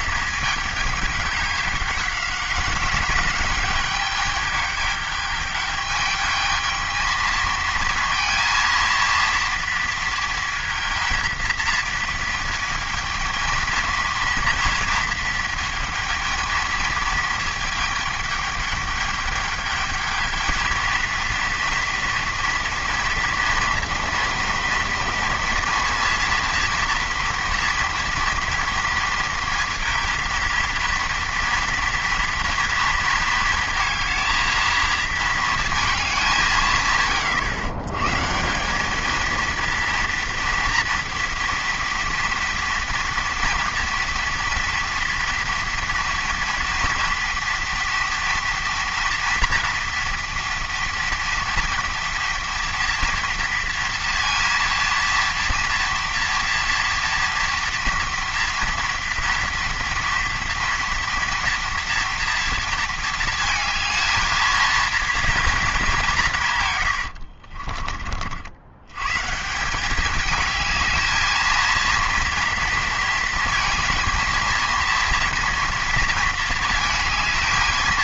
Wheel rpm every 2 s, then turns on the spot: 210, 200, 210, 220, 230, 230, 220, 230, 220, 210, 220, 230, 230, 230, 230, 230, 230, 220, 160, 180, 230, 240, 240, 230, 230, 230, 230, 230, 230, 240, 230, 230, 220, 130, 90, 220, 230, 230, 220.
66-68